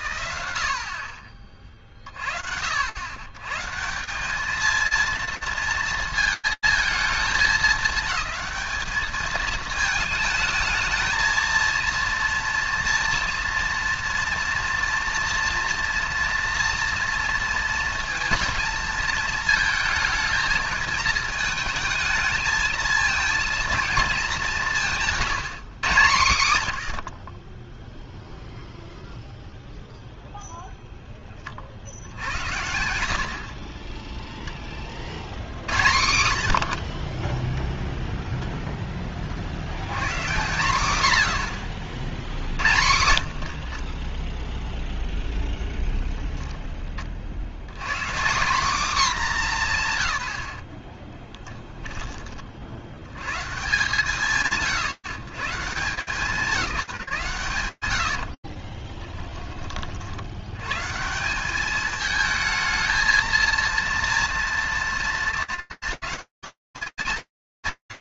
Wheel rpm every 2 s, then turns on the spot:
60, 200, 220, 210, 220, 230, 230, 240, 220, 220, 220, 210, 110, 0, 0, 90, 10, 70, 0, 140, 60, 0, 10, 150, 150, 20, 160, 160, 80, 50, 220, 230, 210, 160.
56-58